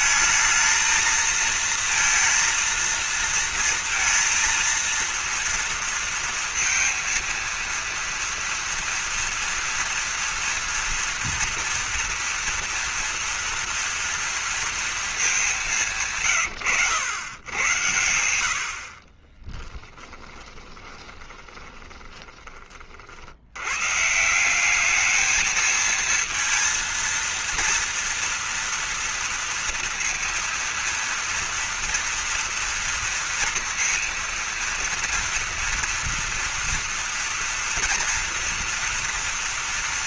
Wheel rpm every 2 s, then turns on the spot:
220, 230, 230, 230, 230, 230, 230, 230, 130, 70, 20, 30, 190, 230, 230, 230, 240, 230, 230, 230.
20-22